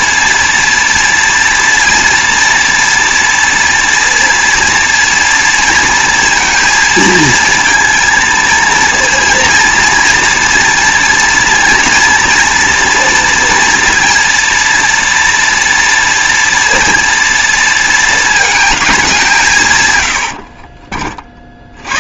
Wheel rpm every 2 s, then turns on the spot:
230, 230, 230, 230, 230, 230, 230, 240, 230, 230, 60.
20-22